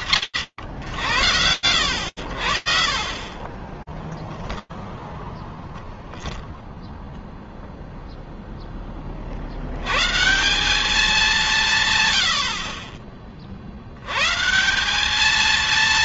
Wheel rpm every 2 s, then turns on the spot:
90, 0, 0, 10, 180, 70, 160, 230.
none